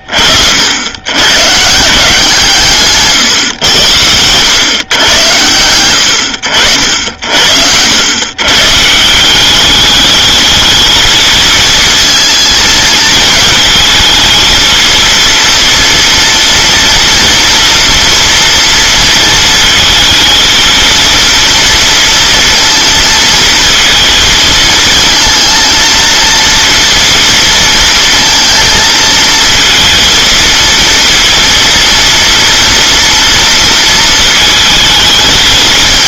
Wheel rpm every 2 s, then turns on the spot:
80, 150, 110, 70, 150, 220, 230, 220, 230, 230, 230, 230, 220, 230, 230, 230, 230, 220.
none